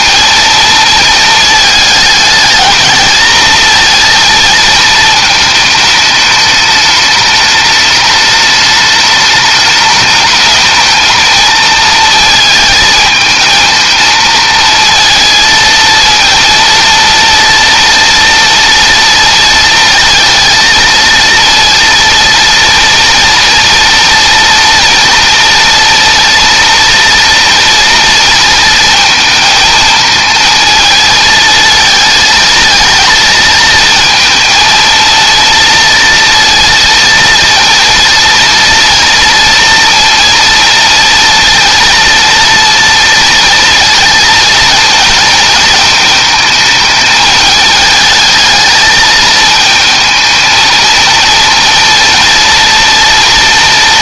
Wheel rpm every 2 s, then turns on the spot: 230, 220, 230, 210, 210, 210, 220, 230, 230, 230, 230, 230, 230, 230, 230, 220, 220, 230, 230, 230, 230, 230, 230, 220, 220, 220, 230.
none